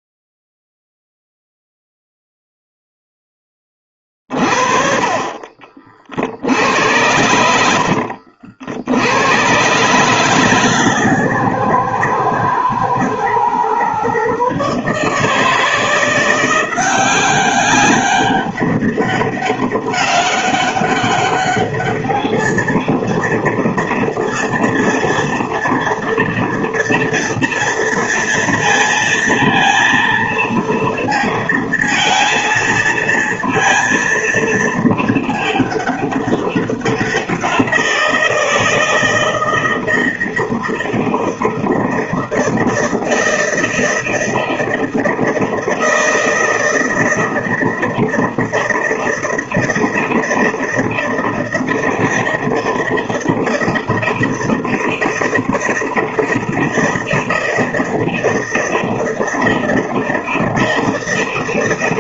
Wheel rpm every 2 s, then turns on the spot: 0, 0, 50, 90, 80, 140, 120, 150, 180, 200, 200, 230, 230, 230, 230, 230, 230, 220, 190, 160, 160, 160, 160, 160, 160, 160, 160, 160, 160, 160, 160.
6-8